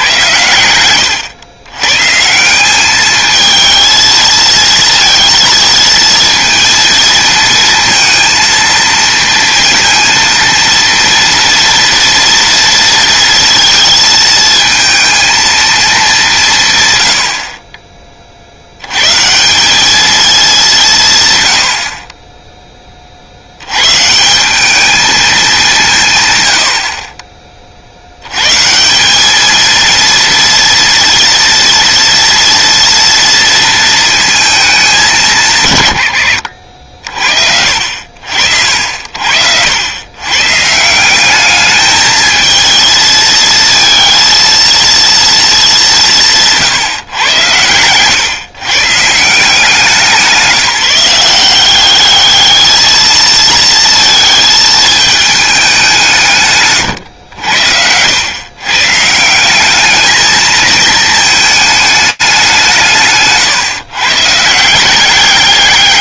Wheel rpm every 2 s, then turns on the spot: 100, 190, 230, 230, 230, 230, 230, 220, 140, 100, 180, 20, 200, 60, 160, 230, 240, 210, 70, 60, 160, 220, 230, 150, 140, 180, 220, 220, 130, 140, 220, 160, 170.
56-58